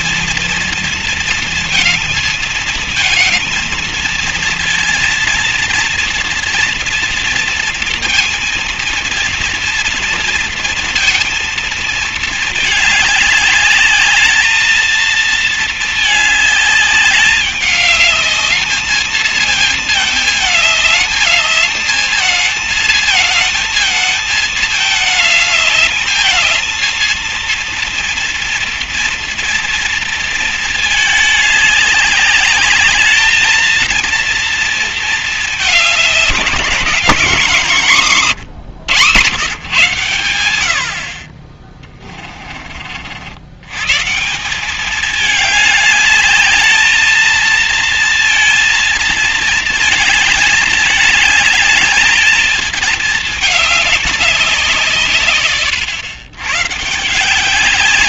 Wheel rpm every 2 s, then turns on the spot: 230, 230, 240, 230, 230, 230, 210, 220, 200, 220, 220, 220, 220, 230, 230, 210, 220, 220, 200, 130, 50, 50, 200, 220, 230, 210, 210, 150, 140.
none